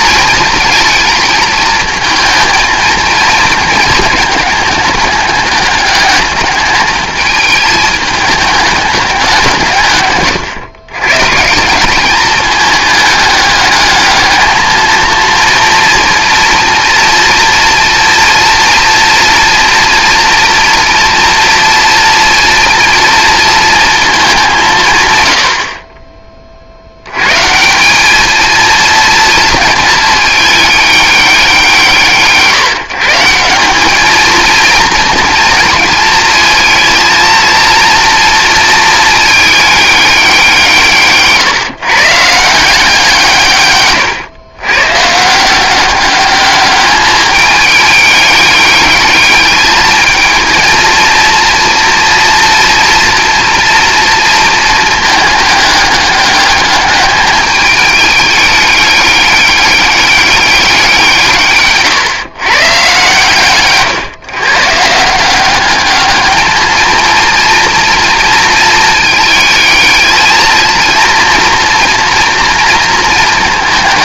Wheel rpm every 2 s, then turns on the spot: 230, 220, 210, 220, 210, 110, 210, 220, 230, 230, 230, 230, 160, 70, 230, 210, 150, 220, 220, 220, 170, 170, 120, 210, 210, 230, 230, 220, 210, 210, 190, 130, 140, 220, 220, 240, 230.
none